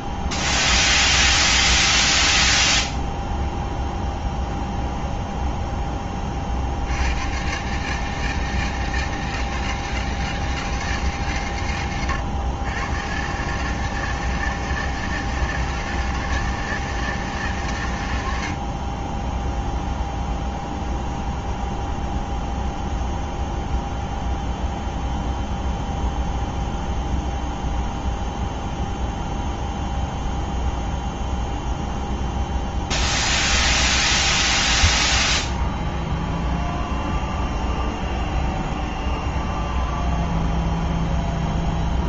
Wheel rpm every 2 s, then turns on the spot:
0, 0, 0, 70, 160, 150, 120, 160, 160, 30, 0, 0, 0, 0, 0, 0, 0, 0, 0, 0, 0.
none